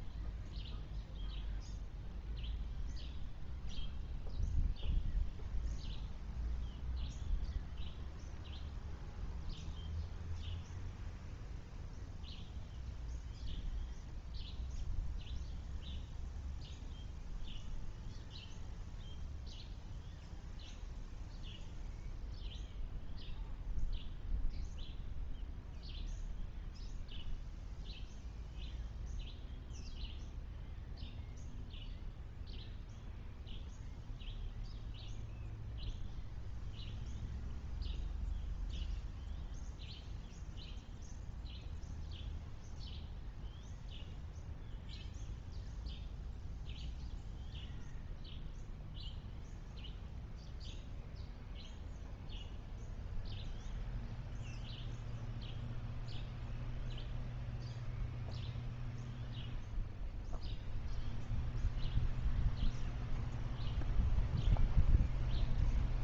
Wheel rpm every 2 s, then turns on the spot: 0, 0, 0, 0, 0, 0, 0, 0, 0, 0, 0, 0, 0, 0, 0, 0, 0, 0, 0, 0, 0, 0, 0, 0, 0, 0, 0, 0, 0, 0, 0, 0, 0.
none